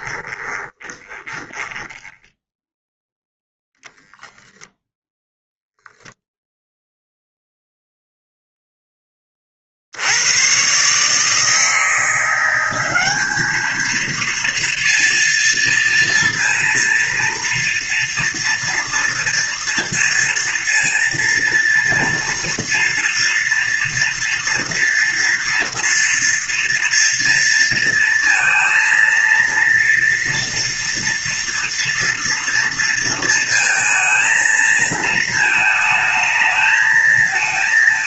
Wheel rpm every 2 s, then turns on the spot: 20, 0, 0, 0, 0, 110, 180, 230, 230, 230, 230, 230, 230, 230, 230, 230, 230, 230, 220.
0-2